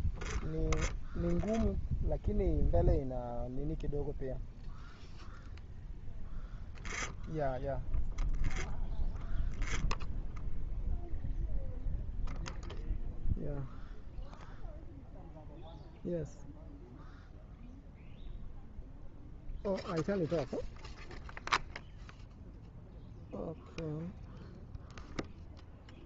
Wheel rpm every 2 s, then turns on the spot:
0, 0, 0, 0, 0, 0, 0, 0, 0, 0, 0, 0, 0.
none